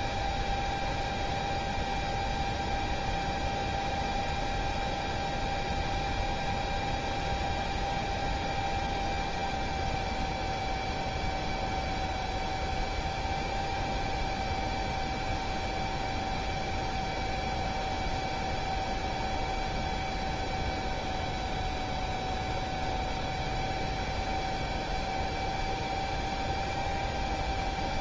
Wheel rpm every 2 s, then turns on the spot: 0, 0, 0, 0, 0, 0, 0, 0, 0, 0, 0, 0, 0, 0.
none